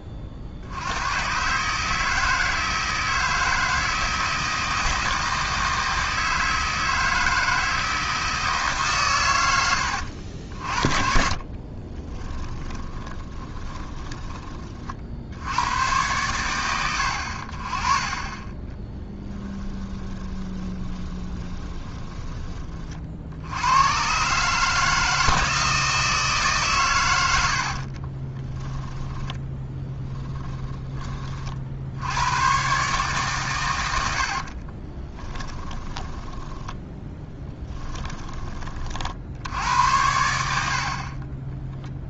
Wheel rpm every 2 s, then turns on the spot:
90, 160, 160, 160, 140, 50, 20, 50, 90, 10, 20, 40, 150, 120, 10, 20, 130, 30, 10, 50, 50.
10-14 18-22 28-30 34-38